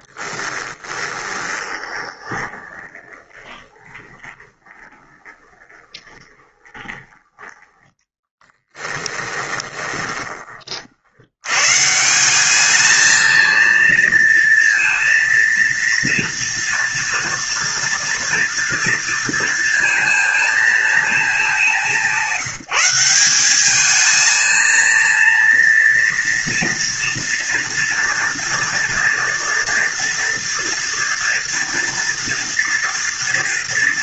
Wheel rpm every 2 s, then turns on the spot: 20, 20, 20, 20, 10, 60, 220, 230, 230, 230, 220, 190, 230, 230, 230, 230, 230.
0-10